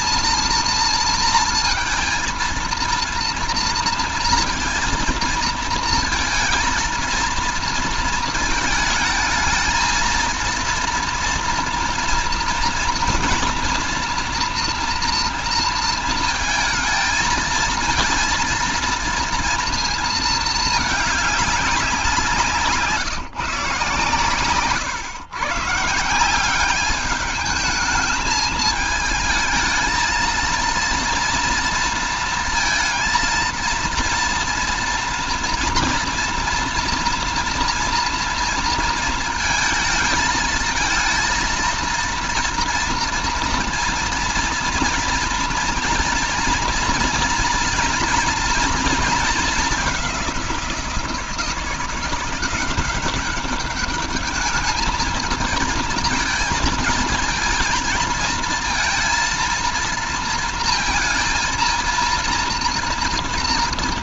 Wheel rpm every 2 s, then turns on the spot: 230, 230, 230, 220, 220, 230, 240, 240, 230, 230, 220, 170, 130, 200, 220, 230, 230, 230, 230, 230, 220, 230, 230, 230, 230, 180, 190, 220, 220, 220, 230, 230.
none